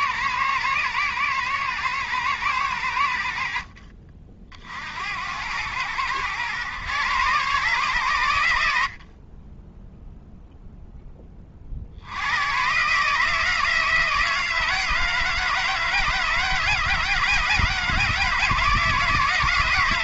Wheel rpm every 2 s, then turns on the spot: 110, 90, 60, 120, 70, 10, 140, 160, 160, 160.
none